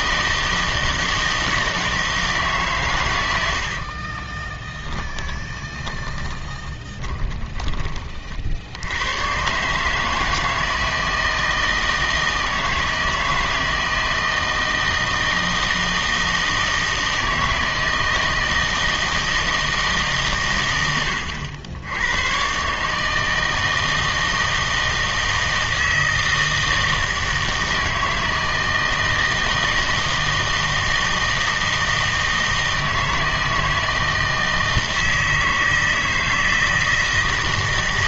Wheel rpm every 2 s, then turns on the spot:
160, 140, 10, 40, 70, 160, 160, 160, 160, 160, 100, 140, 160, 160, 160, 160, 160, 160, 160.
4-8